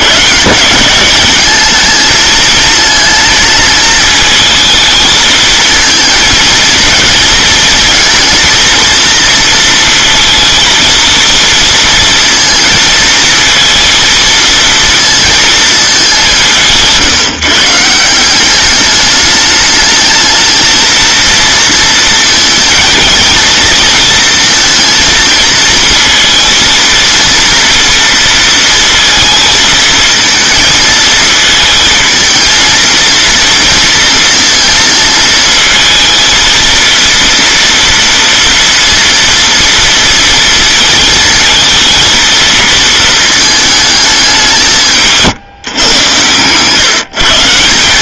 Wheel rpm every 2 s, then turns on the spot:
170, 230, 220, 220, 230, 230, 220, 230, 170, 200, 220, 230, 230, 230, 230, 230, 230, 230, 230, 230, 230, 230, 180, 130.
none